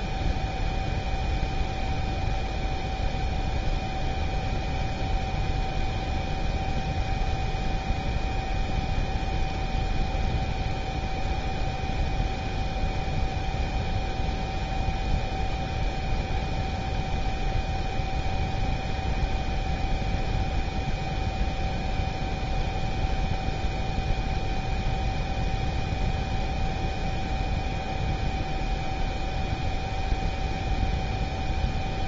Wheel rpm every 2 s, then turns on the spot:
0, 0, 0, 0, 0, 0, 0, 0, 0, 0, 0, 0, 0, 0, 0, 0.
none